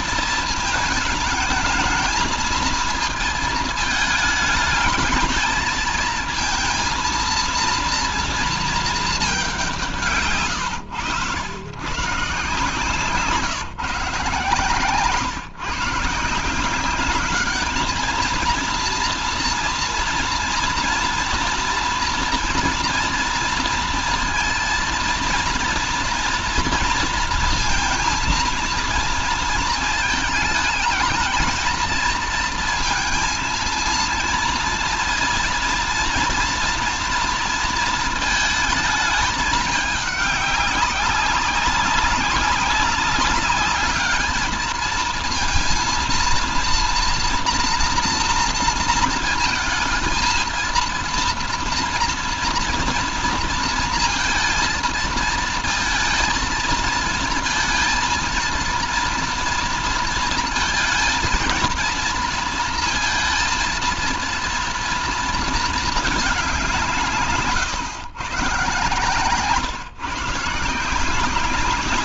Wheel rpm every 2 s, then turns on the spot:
220, 230, 220, 230, 220, 110, 150, 140, 190, 230, 240, 240, 230, 230, 230, 220, 230, 230, 230, 220, 200, 200, 220, 230, 230, 230, 230, 230, 230, 230, 230, 230, 230, 190, 140, 160.
10-12